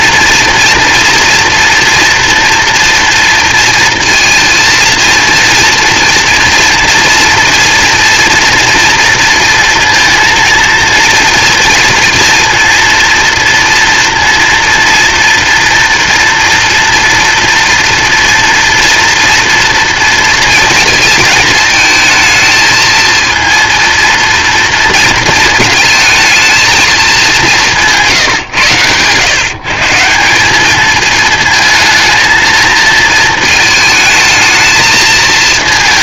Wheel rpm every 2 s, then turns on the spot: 230, 230, 230, 230, 230, 230, 230, 230, 240, 230, 220, 230, 230, 220, 120, 200, 230, 220.
none